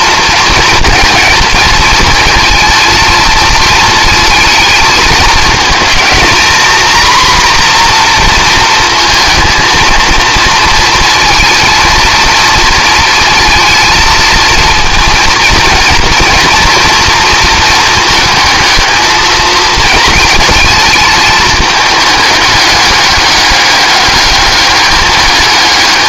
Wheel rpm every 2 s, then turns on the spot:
230, 220, 220, 240, 230, 220, 230, 230, 230, 220, 220, 210, 200.
none